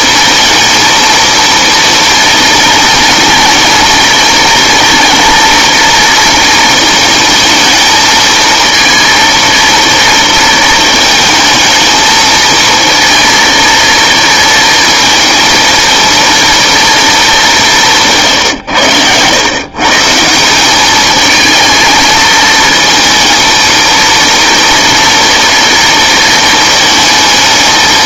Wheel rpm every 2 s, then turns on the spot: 230, 230, 220, 230, 230, 230, 220, 230, 230, 120, 190, 220, 230, 220.
none